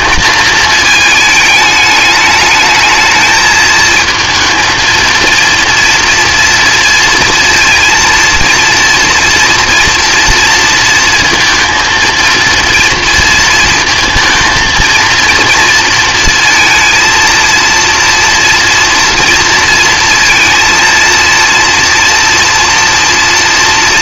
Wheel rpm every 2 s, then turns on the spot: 220, 220, 230, 230, 230, 230, 230, 230, 230, 230, 230, 230.
none